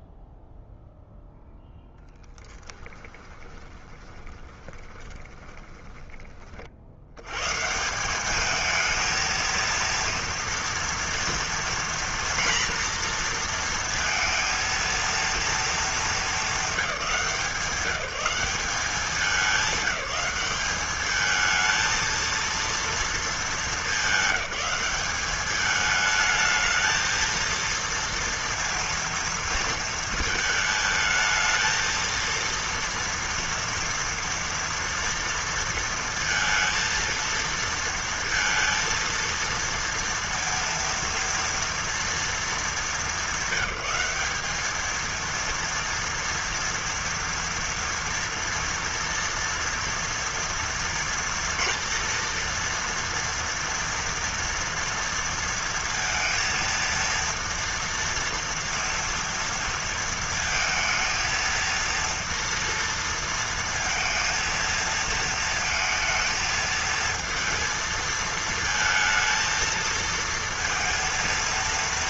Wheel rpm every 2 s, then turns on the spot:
0, 10, 20, 30, 190, 230, 240, 230, 210, 200, 200, 230, 190, 220, 230, 230, 230, 240, 230, 230, 230, 220, 200, 230, 230, 230, 230, 230, 230, 230, 230, 230, 230, 220, 220, 230.
2-6